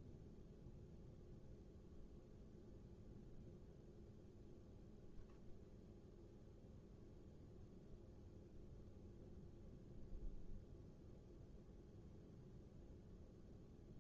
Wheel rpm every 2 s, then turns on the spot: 0, 0, 0, 0, 0, 0, 0.
none